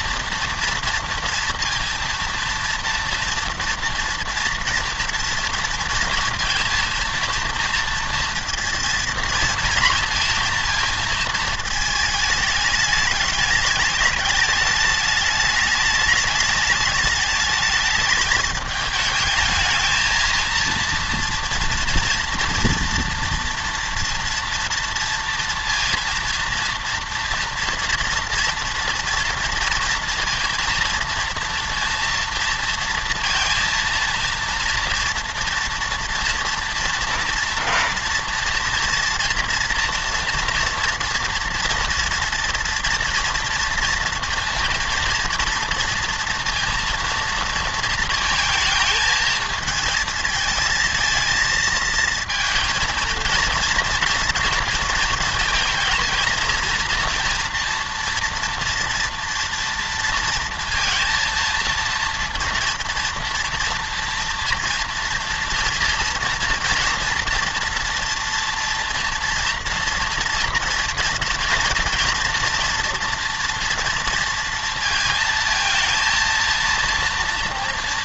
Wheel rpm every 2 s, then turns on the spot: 230, 230, 230, 230, 230, 230, 210, 210, 210, 210, 230, 240, 230, 230, 230, 230, 230, 230, 230, 240, 240, 230, 240, 230, 220, 220, 230, 230, 230, 230, 230, 230, 230, 230, 230, 230, 230, 230, 230.
none